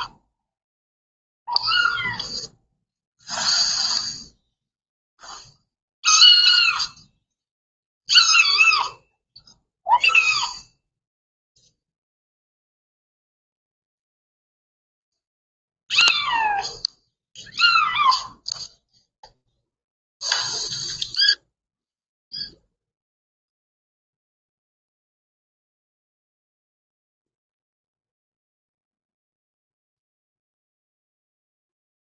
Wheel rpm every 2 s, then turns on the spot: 0, 0, 0, 0, 0, 0, 0, 0, 0, 0, 0, 0, 0, 0, 0, 0.
none